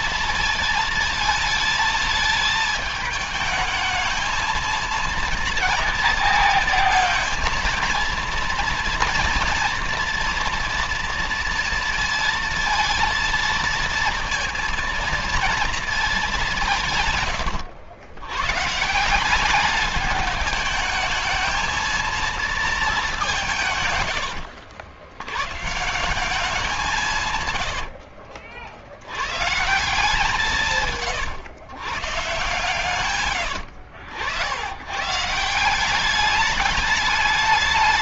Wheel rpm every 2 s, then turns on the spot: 230, 220, 220, 230, 230, 230, 230, 230, 190, 130, 210, 220, 80, 180, 60, 150, 120, 90, 210.
none